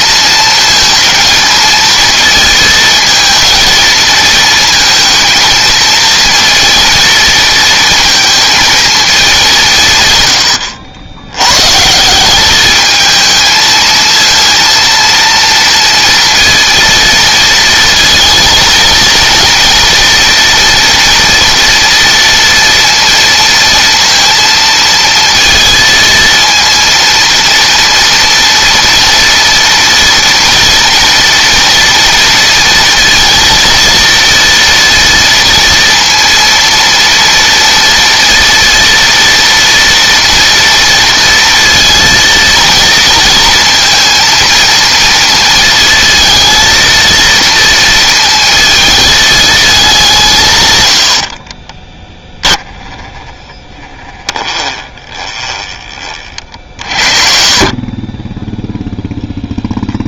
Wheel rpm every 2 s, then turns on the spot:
220, 220, 220, 230, 220, 80, 220, 230, 230, 230, 240, 230, 230, 230, 230, 230, 230, 230, 230, 230, 230, 230, 230, 230, 220, 100, 10, 20, 40, 0.
52-56